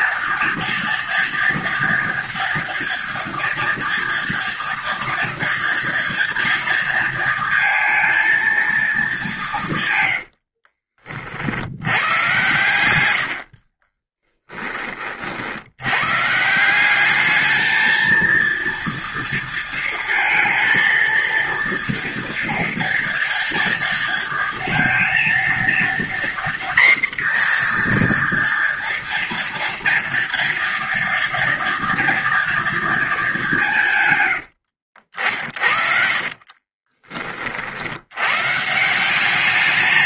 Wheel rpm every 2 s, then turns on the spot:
230, 230, 230, 230, 220, 60, 100, 20, 180, 230, 230, 230, 230, 250, 240, 240, 230, 70, 30, 160.
10-14 34-38